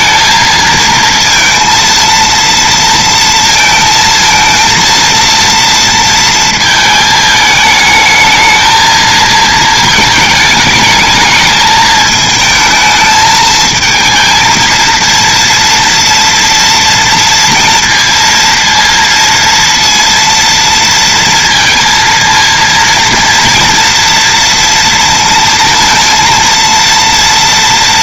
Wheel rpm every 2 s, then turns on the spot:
230, 230, 230, 220, 220, 220, 220, 230, 230, 230, 230, 230, 230, 230.
none